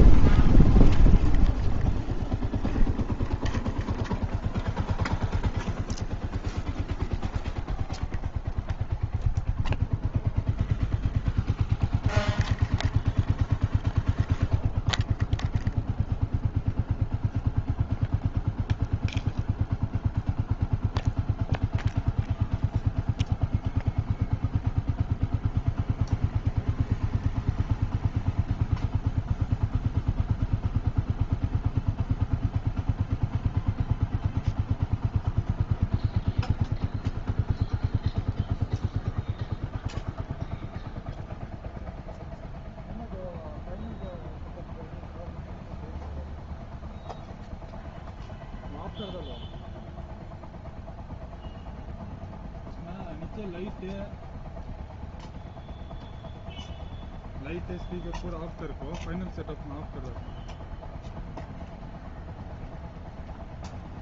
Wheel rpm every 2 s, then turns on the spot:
0, 0, 0, 0, 0, 0, 0, 0, 0, 0, 0, 0, 0, 0, 0, 0, 0, 0, 0, 0, 0, 0, 0, 0, 0, 0, 0, 0, 0, 0, 0, 0.
none